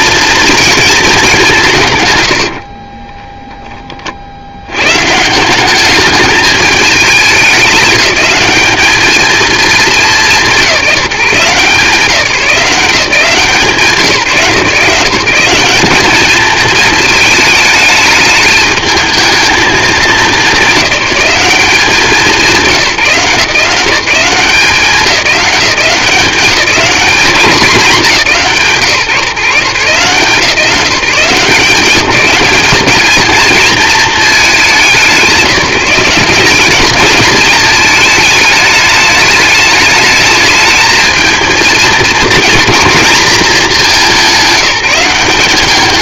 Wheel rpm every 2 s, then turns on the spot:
220, 30, 120, 210, 220, 170, 180, 160, 220, 220, 210, 160, 180, 200, 140, 170, 210, 190, 200, 210, 220, 220, 190.
2-4